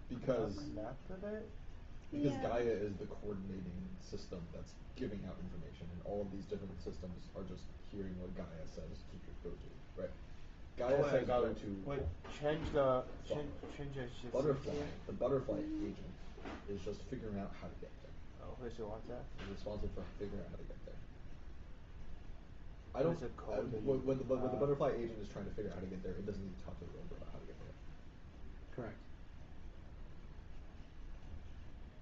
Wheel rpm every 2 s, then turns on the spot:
0, 0, 0, 0, 0, 0, 0, 0, 0, 0, 0, 0, 0, 0, 0, 0.
none